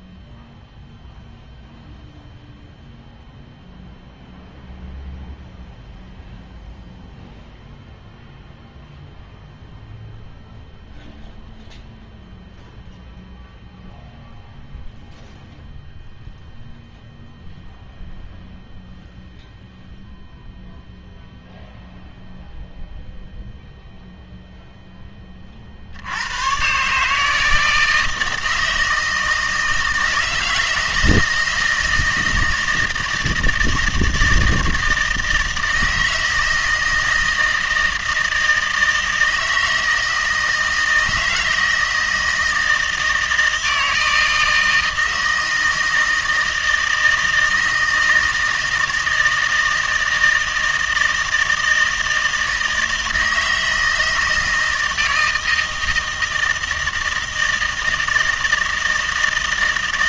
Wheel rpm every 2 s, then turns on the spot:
0, 0, 0, 0, 0, 0, 0, 0, 0, 0, 0, 0, 0, 120, 160, 160, 160, 160, 160, 160, 160, 160, 160, 160, 160, 160, 160, 160, 160, 160.
none